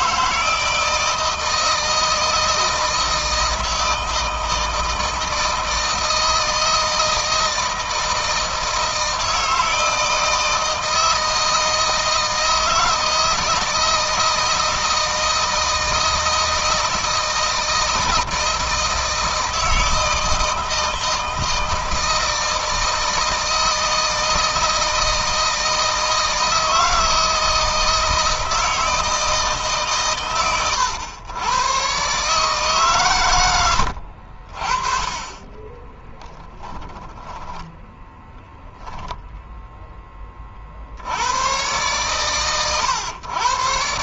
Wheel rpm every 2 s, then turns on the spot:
160, 160, 160, 160, 160, 160, 170, 160, 160, 160, 160, 160, 160, 160, 160, 120, 130, 40, 10, 0, 50, 100.
36-38